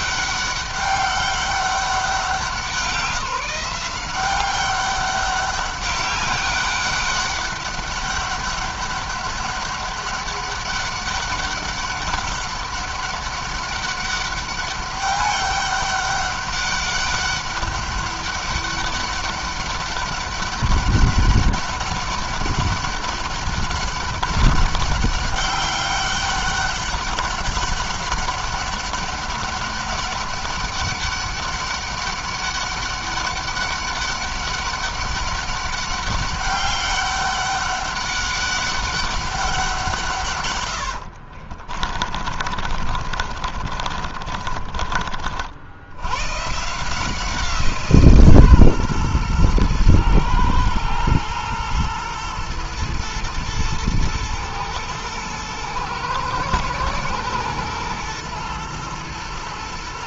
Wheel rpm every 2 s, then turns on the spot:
200, 190, 190, 200, 200, 200, 200, 200, 200, 200, 200, 200, 200, 200, 200, 200, 200, 200, 200, 200, 110, 40, 30, 160, 130, 110, 110, 110, 120, 120.
40-46